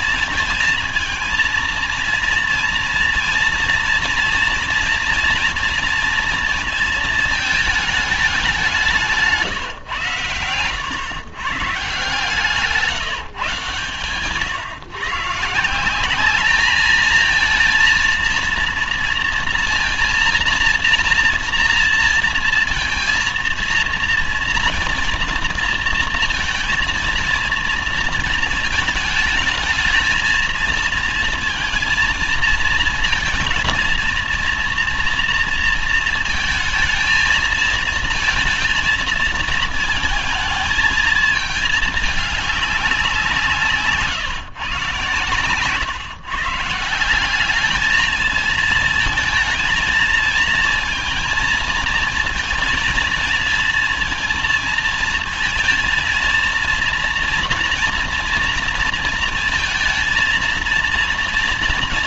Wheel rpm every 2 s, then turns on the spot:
230, 230, 230, 230, 200, 130, 170, 130, 200, 230, 230, 230, 230, 230, 220, 230, 230, 230, 220, 230, 220, 210, 140, 150, 220, 220, 230, 230, 230, 230, 230.
none